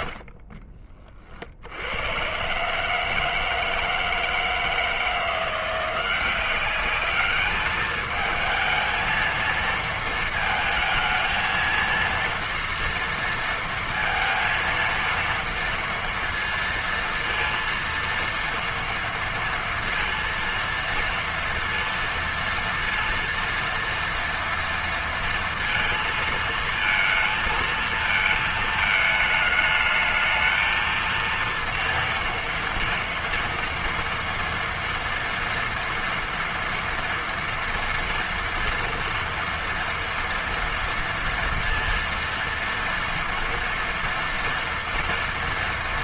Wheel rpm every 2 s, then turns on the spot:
40, 140, 160, 200, 220, 220, 230, 230, 230, 230, 230, 230, 230, 230, 220, 220, 230, 230, 230, 230, 230, 230, 230.
0-2